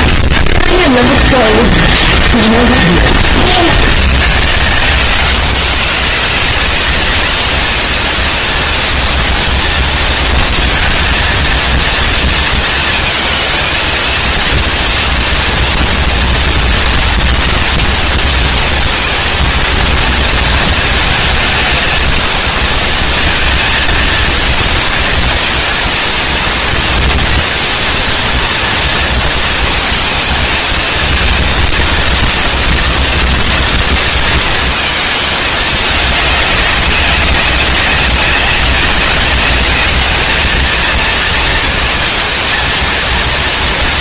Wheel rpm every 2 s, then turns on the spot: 10, 0, 110, 190, 230, 230, 230, 230, 240, 230, 230, 220, 230, 230, 230, 230, 230, 230, 200, 200, 210, 220.
0-2